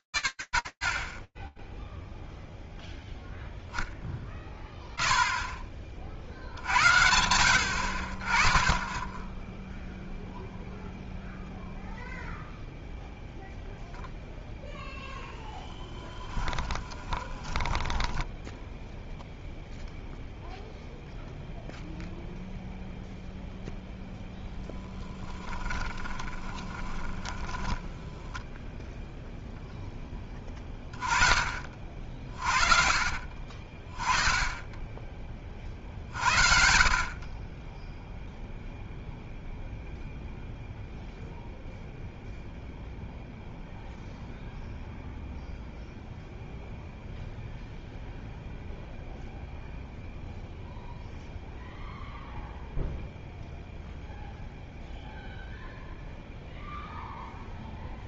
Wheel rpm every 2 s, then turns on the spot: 60, 150, 10, 0, 0, 0, 10, 10, 0, 0, 0, 10, 20, 0, 20, 40, 20, 40, 0, 0, 0, 0, 0, 0, 0, 0, 0, 0, 0.
12-16 22-26